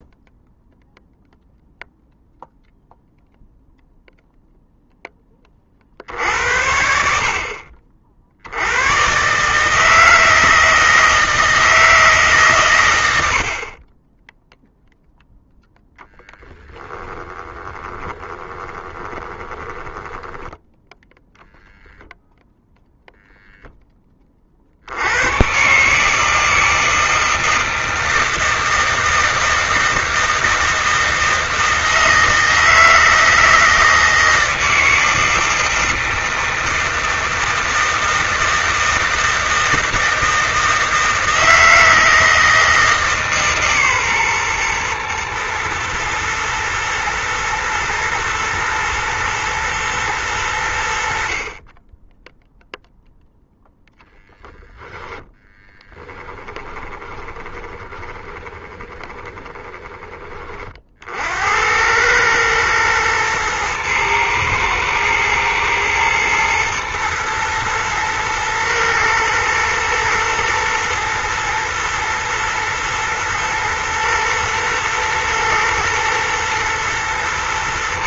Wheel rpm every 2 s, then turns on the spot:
0, 0, 0, 60, 110, 160, 100, 0, 20, 20, 0, 0, 90, 160, 160, 160, 160, 160, 160, 160, 160, 150, 120, 120, 110, 70, 0, 10, 20, 20, 60, 110, 110, 120, 120, 120, 120, 110, 110.
16-20 56-60